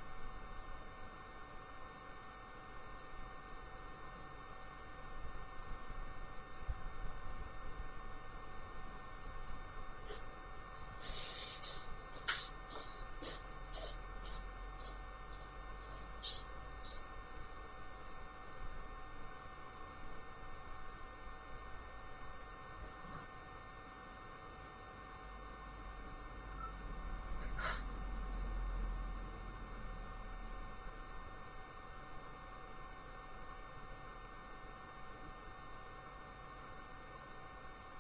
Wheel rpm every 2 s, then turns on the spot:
0, 0, 0, 0, 0, 0, 0, 0, 0, 0, 0, 0, 0, 0, 0, 0, 0, 0, 0.
none